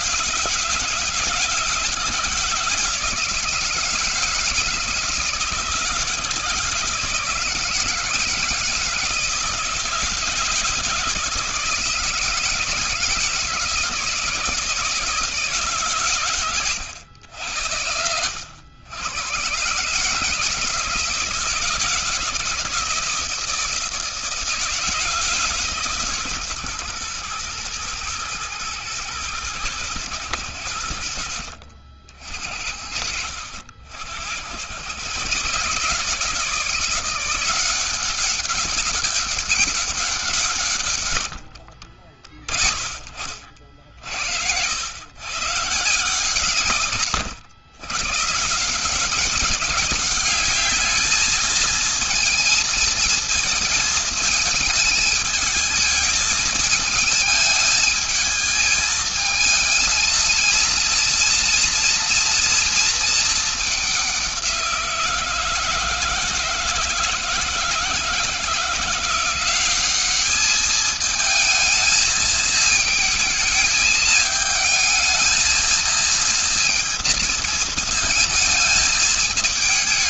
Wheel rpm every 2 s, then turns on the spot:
160, 160, 160, 160, 160, 160, 160, 160, 100, 110, 160, 170, 160, 120, 110, 80, 50, 120, 170, 200, 150, 50, 100, 120, 170, 210, 230, 210, 220, 220, 230, 230, 170, 160, 170, 220, 220, 220, 230, 220.
40-42